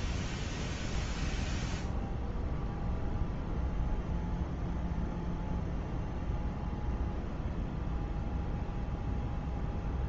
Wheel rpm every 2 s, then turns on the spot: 0, 0, 0, 0, 0.
none